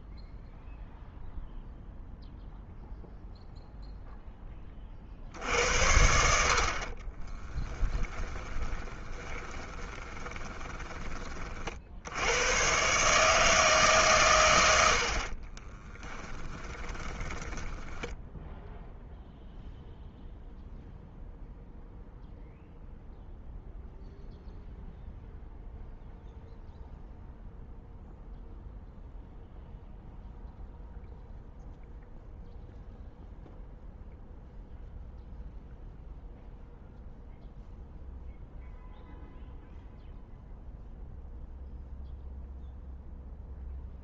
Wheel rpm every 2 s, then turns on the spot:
0, 0, 20, 60, 30, 20, 110, 100, 20, 10, 0, 0, 0, 0, 0, 0, 0, 0, 0, 0, 0, 0.
8-12 16-18